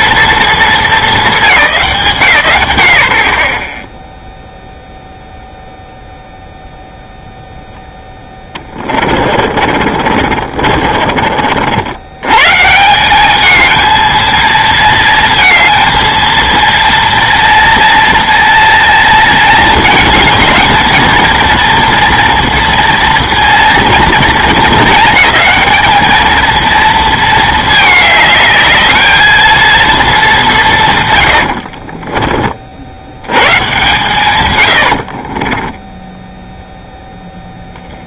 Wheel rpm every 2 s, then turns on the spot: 220, 120, 0, 0, 20, 50, 150, 220, 230, 230, 220, 230, 220, 220, 210, 160, 70, 90, 0.
8-12